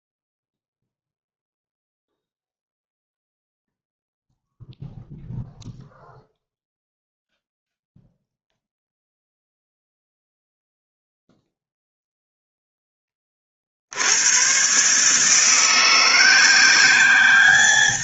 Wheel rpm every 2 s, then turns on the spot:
0, 0, 0, 0, 0, 0, 10, 140, 190.
none